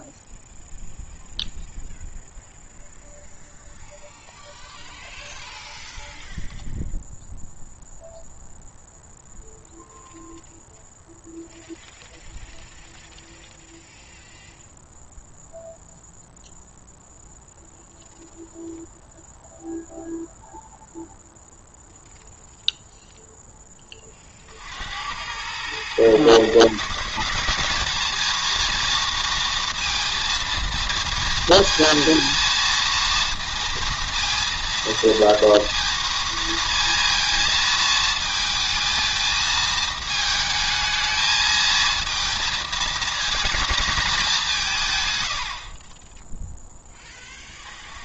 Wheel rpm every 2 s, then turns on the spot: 0, 0, 0, 0, 0, 0, 0, 0, 0, 0, 0, 0, 70, 160, 230, 230, 230, 230, 230, 220, 220, 220, 160, 10.
none